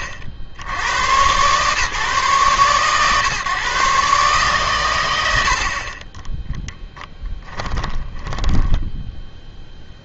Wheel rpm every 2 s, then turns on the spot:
70, 130, 120, 10, 10.
8-10